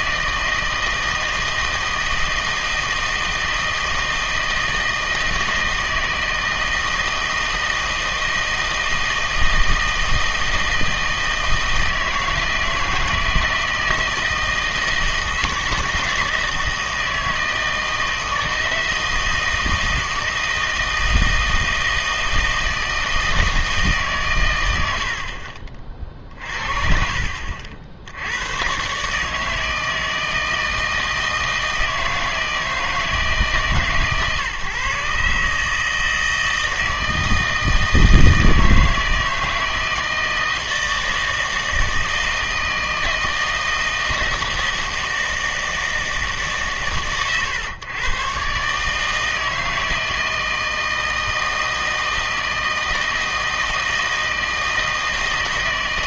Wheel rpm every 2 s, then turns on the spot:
160, 160, 160, 160, 160, 160, 160, 160, 160, 160, 160, 160, 100, 50, 110, 160, 160, 140, 160, 160, 160, 160, 160, 140, 140, 160, 160, 160.
none